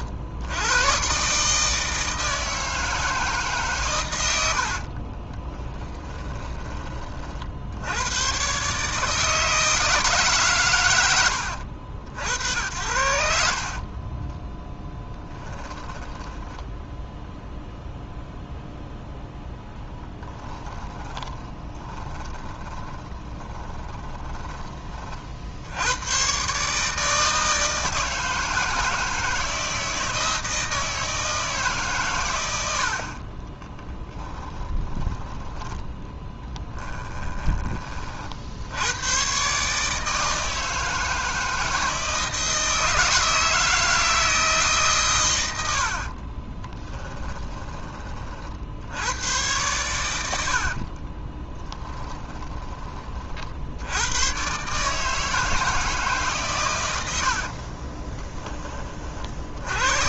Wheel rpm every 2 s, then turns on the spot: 110, 160, 50, 20, 150, 140, 80, 0, 10, 0, 20, 20, 30, 150, 160, 160, 60, 20, 10, 90, 160, 160, 140, 20, 70, 60, 20, 140, 110, 30.
4-6 20-24 34-38 46-48 50-52